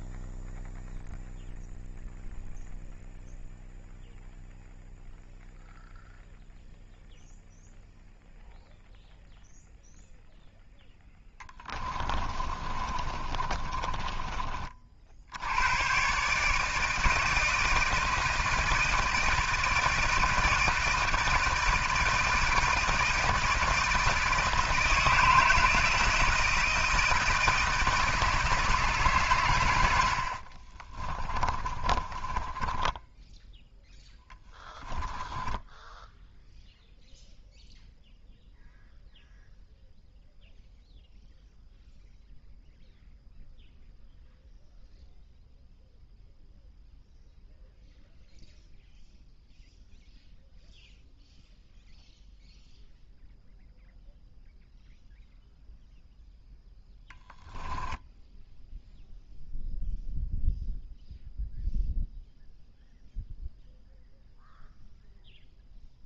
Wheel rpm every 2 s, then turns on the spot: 0, 0, 0, 0, 0, 0, 30, 40, 160, 160, 160, 160, 160, 160, 150, 40, 10, 10, 0, 0, 0, 0, 0, 0, 0, 0, 0, 0, 0, 0, 0, 0, 0.
12-14 30-36